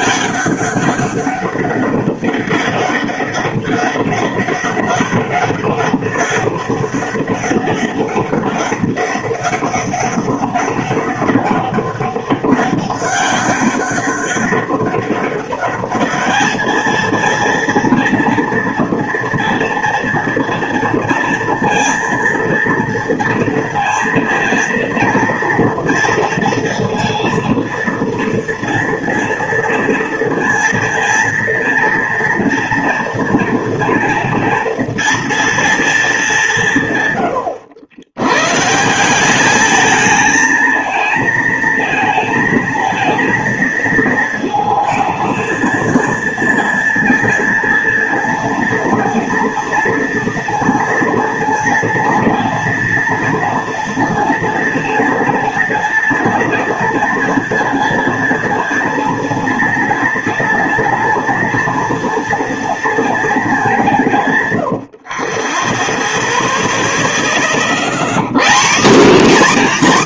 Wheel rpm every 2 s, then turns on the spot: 200, 200, 200, 200, 200, 190, 200, 200, 220, 230, 230, 230, 230, 230, 230, 230, 230, 230, 160, 150, 220, 230, 220, 230, 230, 230, 230, 230, 230, 230, 230, 230, 90, 0, 220.
none